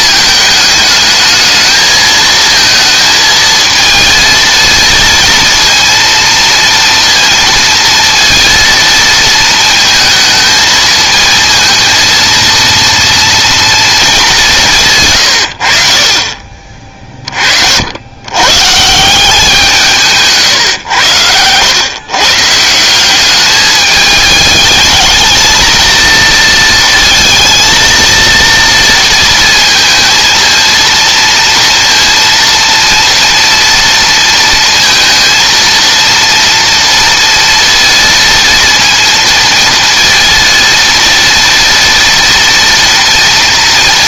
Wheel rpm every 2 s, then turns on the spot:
220, 230, 230, 230, 230, 220, 230, 170, 30, 130, 130, 160, 210, 230, 230, 230, 230, 230, 230, 230, 230, 230.
none